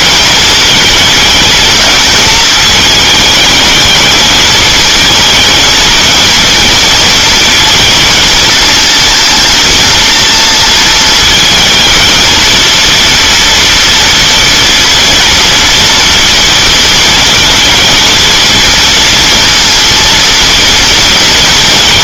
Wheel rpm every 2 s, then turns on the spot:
230, 220, 230, 230, 230, 230, 230, 230, 230, 230, 230.
none